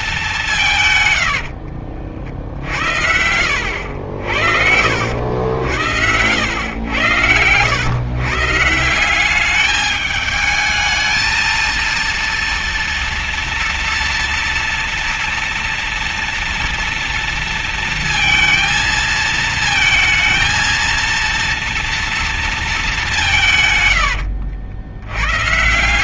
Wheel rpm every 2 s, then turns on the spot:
120, 70, 60, 110, 170, 220, 230, 230, 230, 220, 230, 190, 80.
0-4 24-26